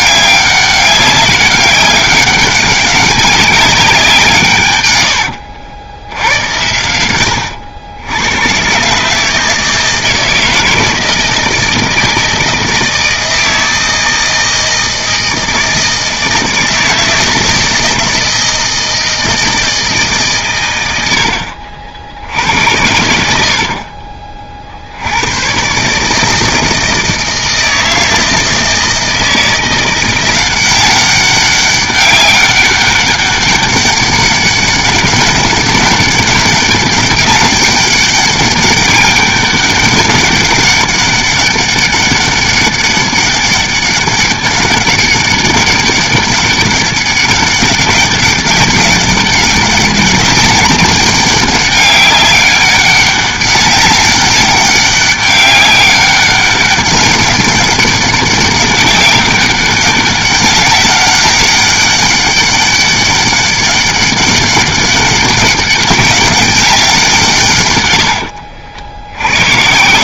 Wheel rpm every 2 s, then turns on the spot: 200, 200, 150, 100, 120, 160, 160, 160, 160, 160, 120, 80, 50, 160, 160, 180, 200, 200, 200, 200, 200, 200, 200, 200, 200, 200, 200, 200, 190, 200, 200, 200, 200, 200, 70.
68-70